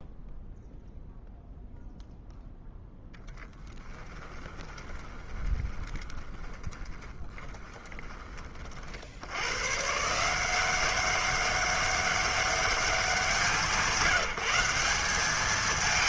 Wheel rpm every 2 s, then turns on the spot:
0, 0, 20, 20, 50, 190, 200, 190.
4-8